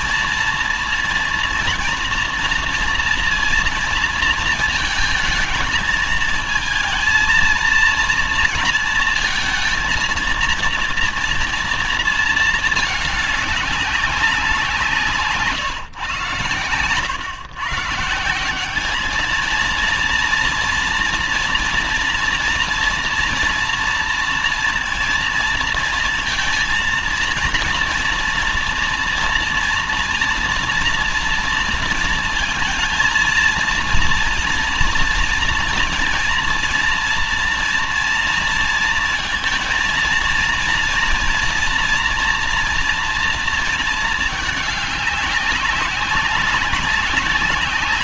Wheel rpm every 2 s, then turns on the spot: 240, 230, 230, 230, 230, 230, 220, 180, 120, 180, 240, 230, 230, 230, 240, 230, 230, 230, 230, 230, 230, 230, 220, 200.
none